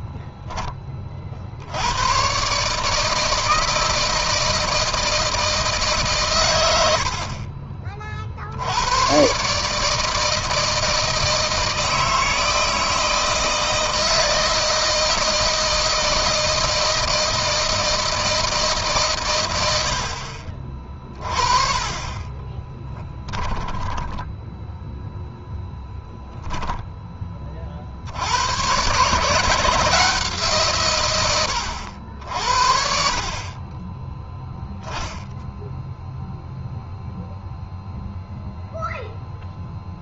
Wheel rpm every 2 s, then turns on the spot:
20, 150, 160, 80, 100, 160, 160, 160, 160, 150, 40, 10, 10, 10, 110, 120, 60, 0, 0, 0.
22-24